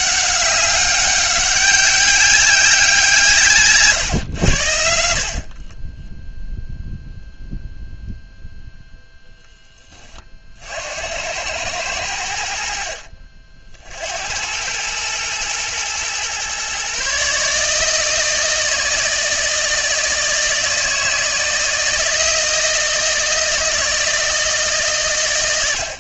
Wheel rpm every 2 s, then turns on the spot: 200, 180, 70, 0, 0, 70, 60, 100, 130, 160, 160, 160, 140.
none